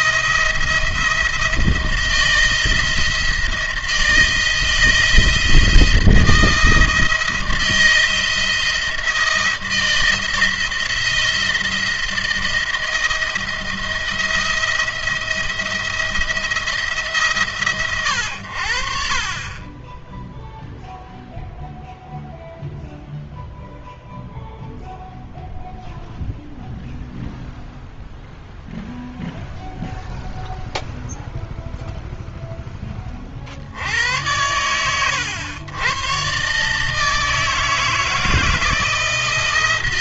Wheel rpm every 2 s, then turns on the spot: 170, 170, 160, 170, 170, 170, 170, 170, 160, 70, 0, 0, 0, 0, 0, 0, 10, 100, 140, 160.
none